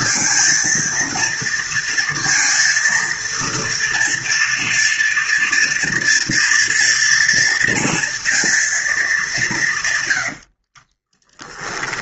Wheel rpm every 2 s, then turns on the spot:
230, 230, 230, 240, 230, 80.
10-12